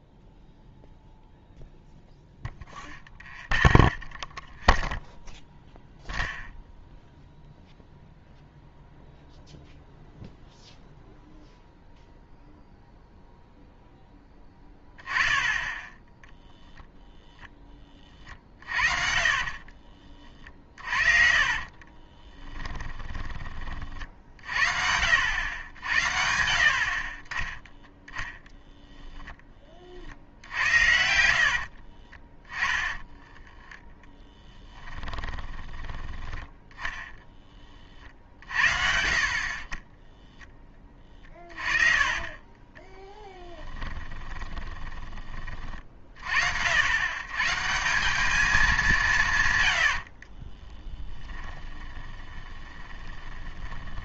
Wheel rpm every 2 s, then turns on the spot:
0, 0, 0, 0, 0, 0, 0, 10, 0, 40, 40, 20, 70, 60, 0, 80, 10, 20, 10, 60, 20, 20, 20, 80, 210, 30, 20.
18-24 30-36 40-42 44-46 50-54